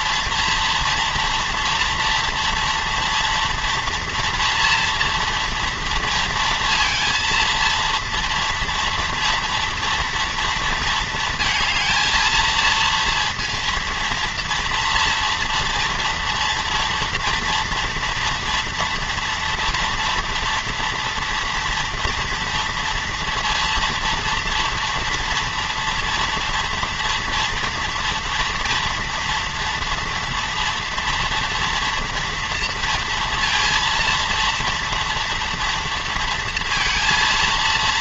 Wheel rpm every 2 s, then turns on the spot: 230, 230, 240, 230, 230, 230, 230, 230, 230, 240, 230, 230, 230, 230, 230, 230, 230, 230, 230.
none